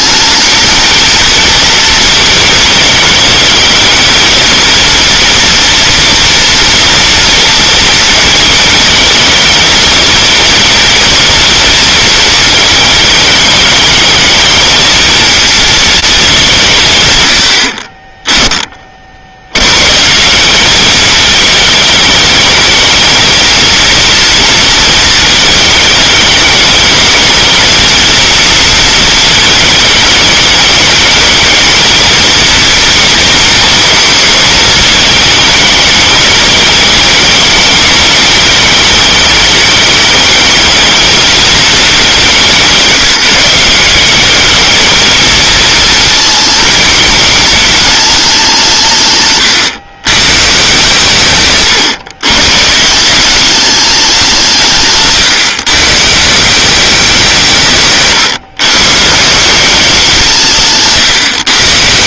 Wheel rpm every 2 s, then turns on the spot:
220, 220, 230, 230, 220, 220, 220, 220, 180, 10, 190, 210, 230, 210, 230, 210, 230, 220, 210, 210, 220, 180, 210, 230, 180, 140, 140, 160, 180, 130, 150.
none